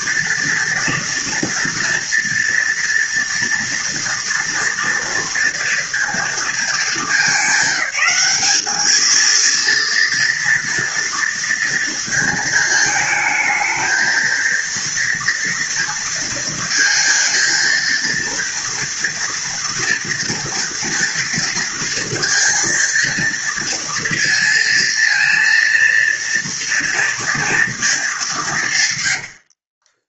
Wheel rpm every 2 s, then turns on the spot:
230, 230, 230, 220, 210, 230, 230, 230, 230, 230, 230, 230, 230, 230, 200.
none